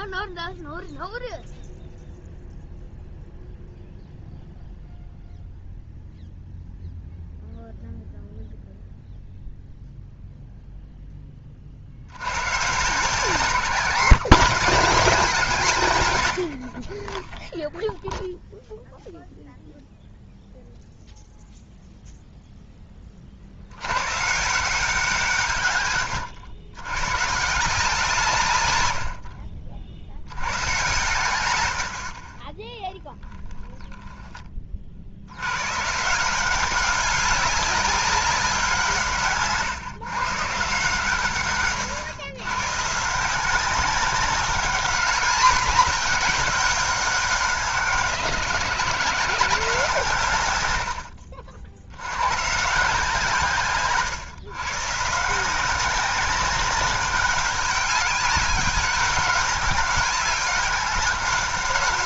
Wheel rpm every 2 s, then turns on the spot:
0, 0, 0, 0, 0, 0, 120, 200, 60, 0, 0, 10, 170, 110, 120, 110, 20, 30, 180, 180, 150, 140, 200, 190, 120, 110, 150, 130, 190, 200, 200.
none